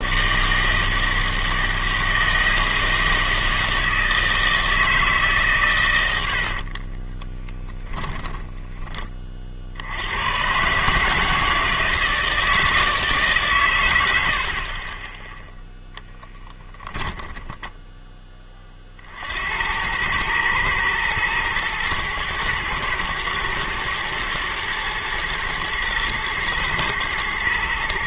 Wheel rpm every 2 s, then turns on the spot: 160, 160, 160, 40, 10, 140, 160, 30, 10, 40, 110, 110, 110, 120.
6-8 14-18